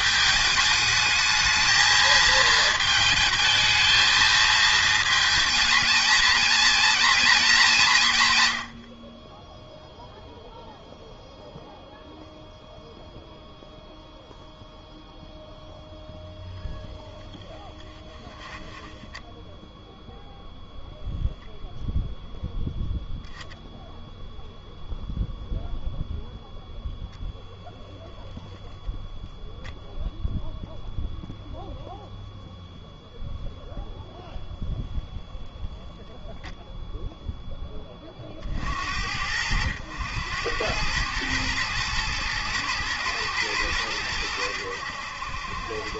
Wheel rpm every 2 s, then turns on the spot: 220, 220, 230, 230, 110, 0, 0, 0, 0, 10, 0, 0, 0, 0, 0, 0, 0, 0, 0, 70, 100, 110, 90.
18-20